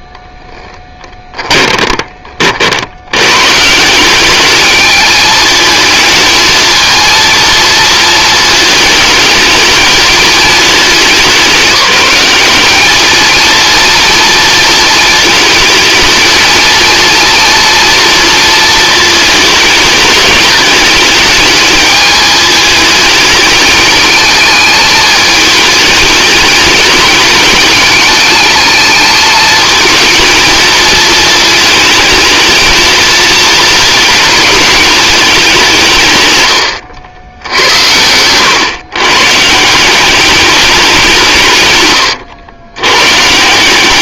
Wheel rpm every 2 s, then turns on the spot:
10, 80, 210, 230, 220, 190, 210, 230, 230, 220, 210, 220, 220, 200, 210, 220, 220, 210, 90, 130, 180, 110.
0-2